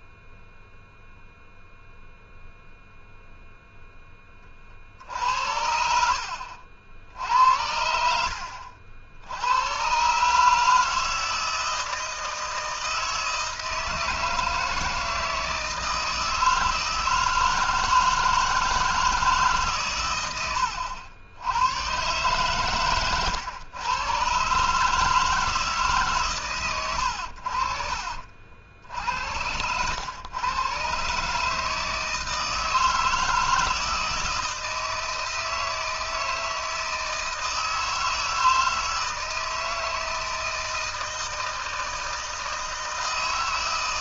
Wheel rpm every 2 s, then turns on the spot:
0, 0, 60, 70, 60, 160, 160, 160, 160, 160, 90, 120, 150, 100, 60, 120, 160, 160, 160, 160, 160, 160.
none